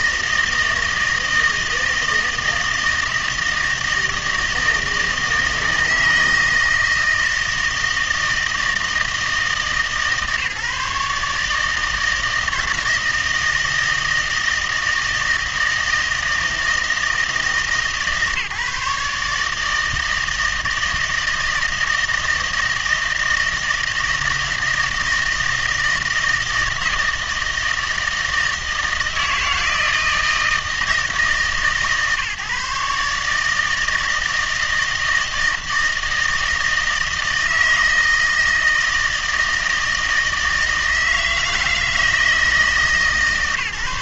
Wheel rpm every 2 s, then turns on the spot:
160, 160, 160, 160, 160, 150, 170, 160, 160, 150, 160, 160, 160, 160, 160, 160, 150, 160, 160, 160, 160, 160.
none